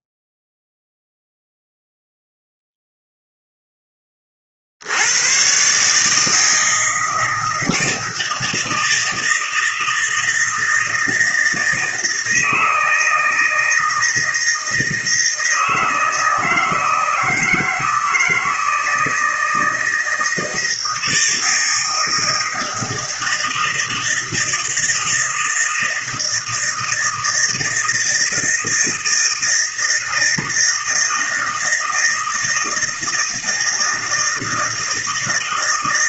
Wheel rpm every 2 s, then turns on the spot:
0, 0, 60, 160, 160, 160, 160, 160, 160, 160, 160, 160, 160, 160, 160, 160, 160, 160.
none